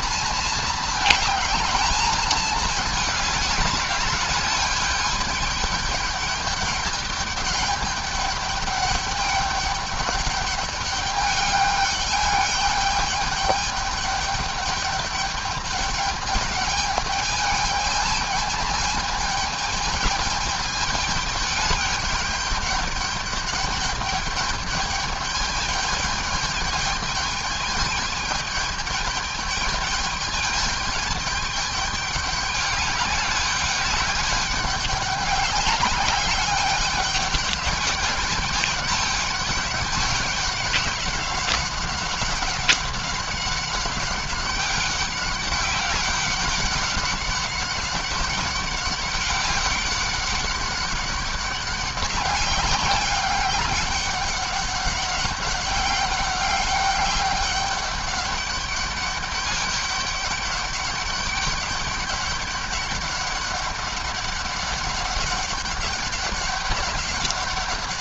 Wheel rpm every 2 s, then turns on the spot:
220, 210, 200, 210, 210, 200, 210, 210, 210, 220, 210, 210, 210, 210, 210, 210, 200, 200, 210, 210, 200, 190, 200, 200, 190, 200, 200, 200, 200, 200, 200, 200, 200, 200.
none